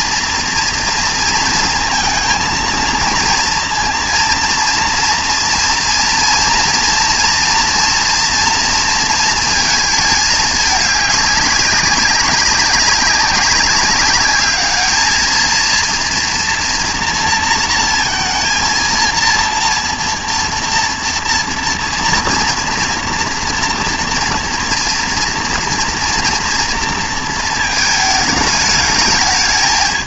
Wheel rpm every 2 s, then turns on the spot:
230, 230, 230, 230, 230, 210, 200, 210, 230, 230, 230, 240, 230, 230, 210.
none